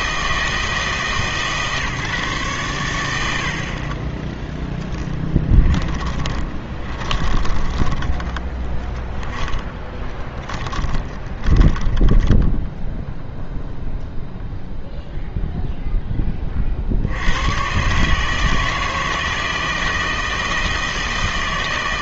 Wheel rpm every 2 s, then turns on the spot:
160, 120, 10, 20, 10, 20, 10, 0, 30, 160, 160.
6-14